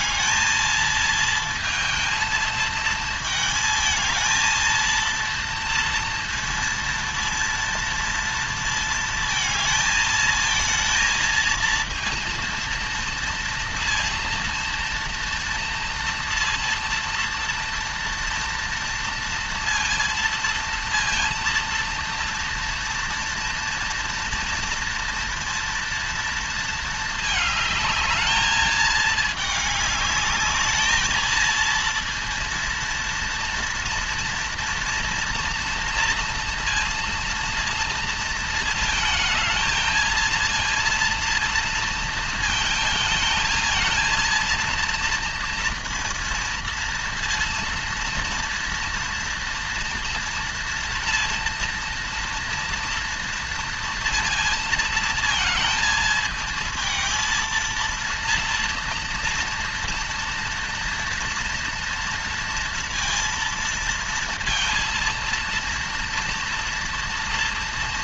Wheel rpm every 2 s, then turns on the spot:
230, 230, 220, 230, 230, 220, 230, 230, 230, 230, 230, 230, 230, 230, 220, 210, 230, 230, 230, 230, 230, 230, 220, 230, 230, 230, 230, 230, 220, 230, 230, 230, 230, 230.
none